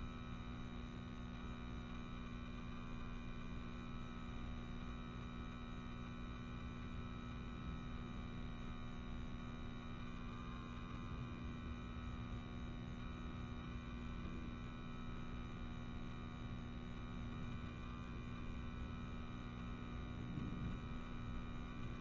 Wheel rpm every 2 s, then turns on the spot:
0, 0, 0, 0, 0, 0, 0, 0, 0, 0, 0.
none